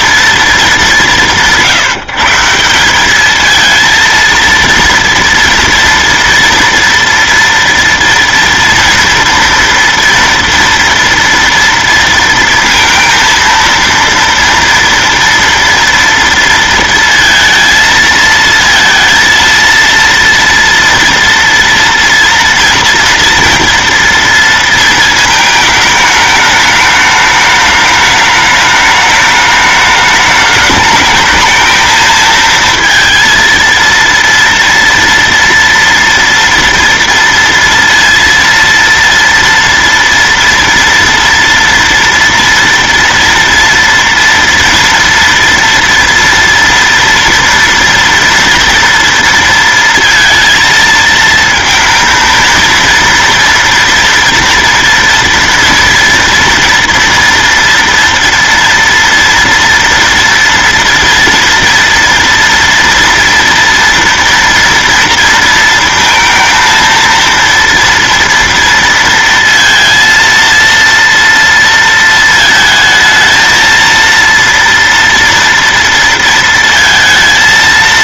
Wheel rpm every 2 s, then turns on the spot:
200, 190, 230, 230, 230, 230, 230, 230, 230, 230, 230, 230, 230, 210, 210, 210, 230, 230, 230, 230, 230, 230, 230, 230, 240, 230, 230, 230, 230, 230, 230, 230, 230, 230, 230, 230, 220, 230, 230.
none